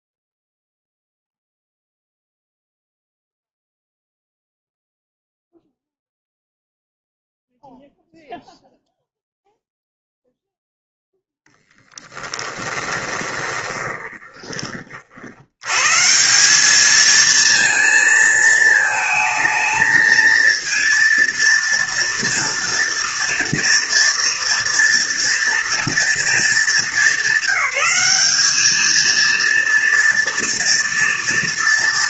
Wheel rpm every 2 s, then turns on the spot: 0, 0, 0, 0, 0, 0, 20, 30, 190, 220, 230, 230, 240, 220, 210, 230.
12-14